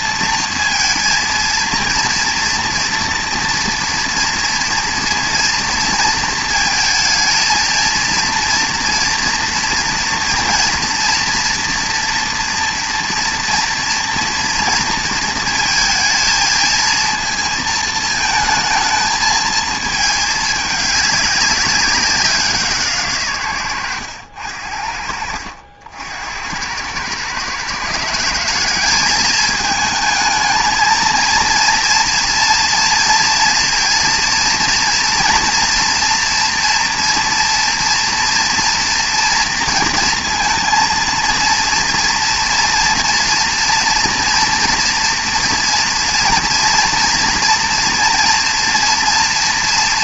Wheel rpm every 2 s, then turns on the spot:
230, 240, 230, 230, 230, 230, 230, 230, 220, 220, 200, 150, 60, 100, 200, 220, 230, 230, 240, 240, 230, 230, 230, 230, 230.
none